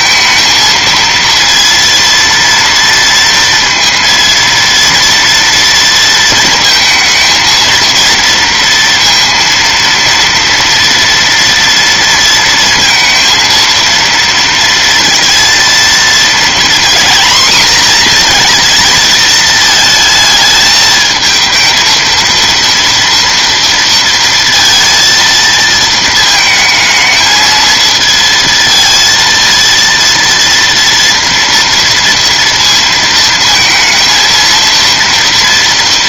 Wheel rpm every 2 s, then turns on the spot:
230, 230, 230, 220, 230, 230, 230, 230, 230, 230, 220, 230, 230, 220, 230, 230, 230, 230.
none